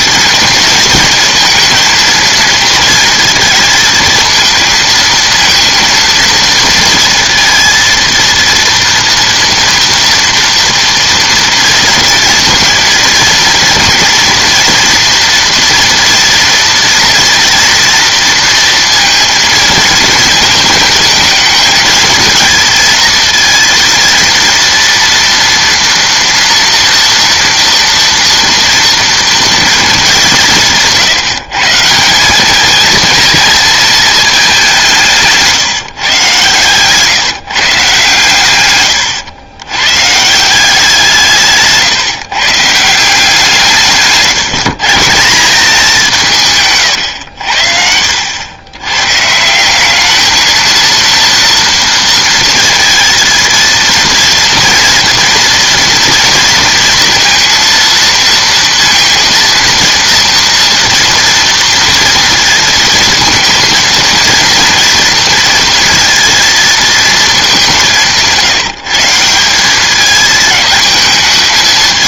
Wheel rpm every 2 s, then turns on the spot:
230, 230, 220, 230, 230, 230, 230, 230, 230, 230, 230, 230, 230, 230, 230, 160, 220, 200, 140, 120, 170, 150, 160, 140, 100, 220, 230, 230, 230, 230, 230, 230, 230, 220, 160, 220.
36-38 46-48